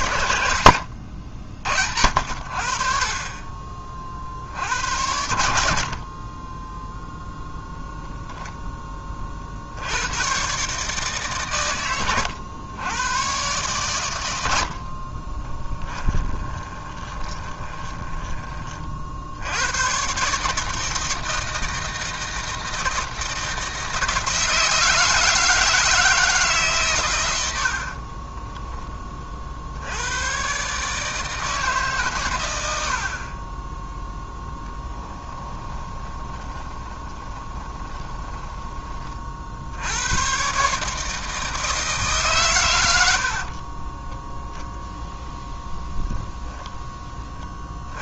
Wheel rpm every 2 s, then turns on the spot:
90, 50, 70, 0, 10, 140, 100, 60, 20, 40, 160, 160, 160, 130, 10, 140, 70, 20, 20, 20, 150, 100, 0, 20.
16-18 34-38 46-48